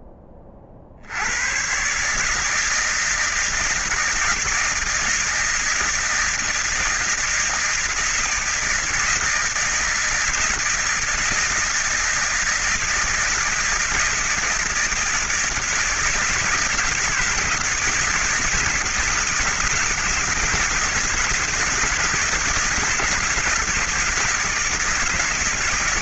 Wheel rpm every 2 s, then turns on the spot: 20, 160, 160, 160, 160, 160, 160, 160, 160, 160, 170, 170, 170.
none